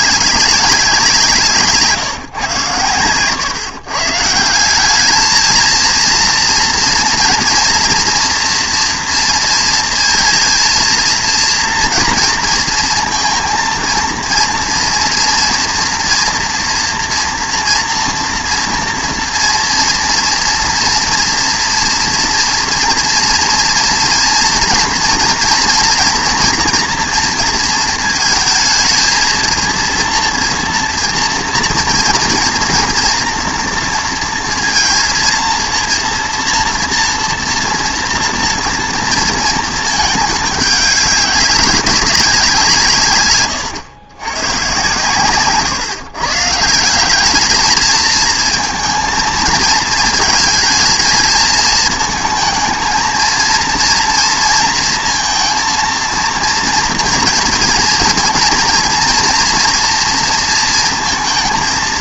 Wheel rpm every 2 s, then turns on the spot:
200, 120, 190, 230, 240, 230, 230, 230, 240, 230, 240, 230, 230, 230, 220, 230, 230, 230, 230, 230, 210, 170, 120, 150, 230, 220, 220, 230, 230, 230, 230.
none